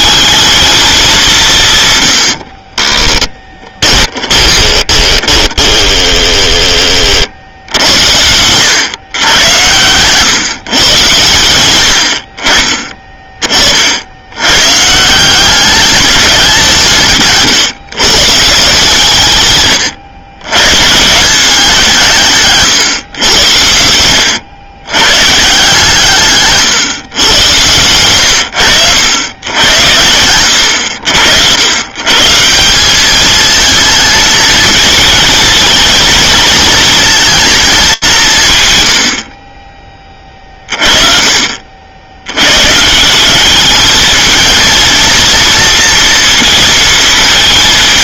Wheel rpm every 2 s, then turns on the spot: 220, 50, 20, 10, 100, 140, 50, 130, 180, 160, 120, 130, 100, 140, 100, 90, 160, 220, 230, 140, 40, 120, 230, 230.
2-6 26-28